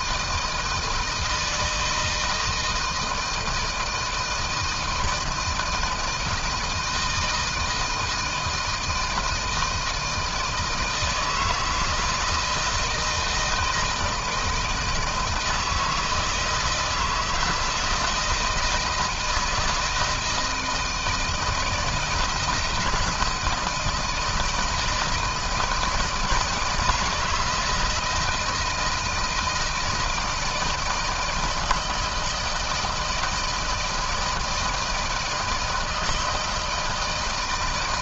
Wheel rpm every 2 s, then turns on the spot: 160, 160, 160, 160, 160, 160, 160, 160, 160, 160, 160, 160, 160, 160, 170, 160, 160, 160, 160.
none